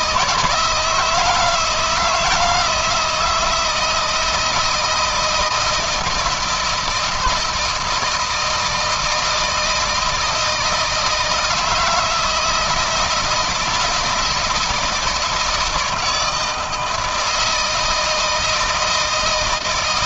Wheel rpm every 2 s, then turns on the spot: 160, 160, 160, 170, 160, 160, 160, 160, 160, 160.
none